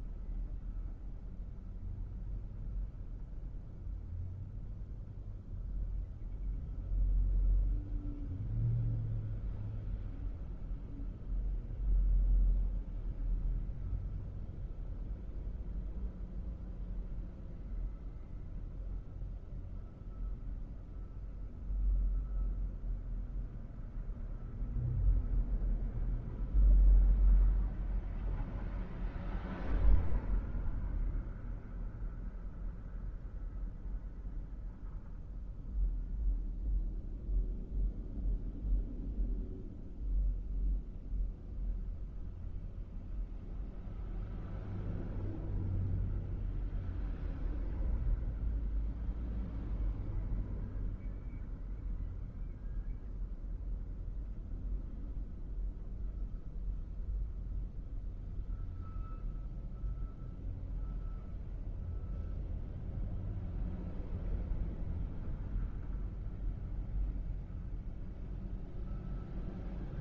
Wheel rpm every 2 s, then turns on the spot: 0, 0, 0, 0, 0, 0, 0, 0, 0, 0, 0, 0, 0, 0, 0, 0, 0, 0, 0, 0, 0, 0, 0, 0, 0, 0, 0, 0, 0, 0, 0, 0, 0, 0, 0.
none